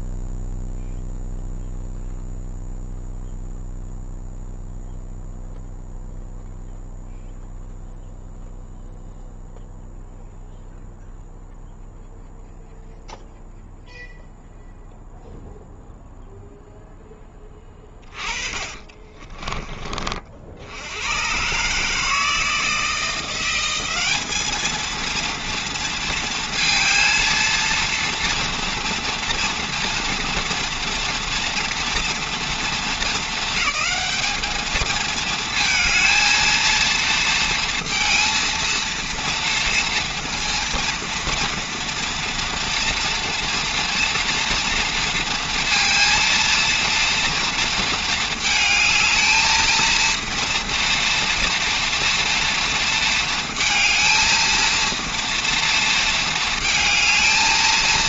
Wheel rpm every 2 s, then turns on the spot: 0, 0, 0, 0, 0, 0, 0, 0, 0, 40, 70, 160, 220, 230, 230, 230, 230, 210, 230, 230, 230, 230, 230, 230, 220, 230, 230, 230, 230.
18-20